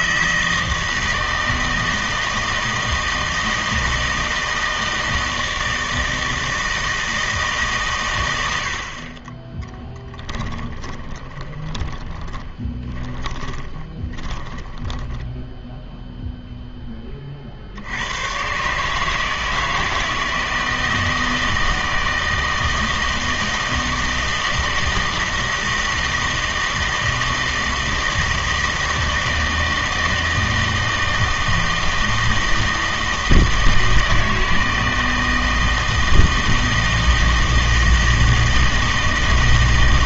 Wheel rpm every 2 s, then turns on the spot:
160, 160, 160, 160, 80, 20, 20, 10, 0, 130, 160, 160, 160, 160, 160, 160, 160, 160, 160, 160.
10-16